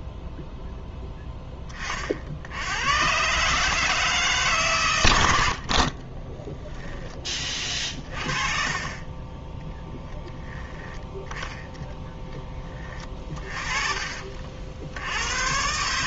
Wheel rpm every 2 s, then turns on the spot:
0, 90, 140, 10, 30, 10, 20, 50.
8-10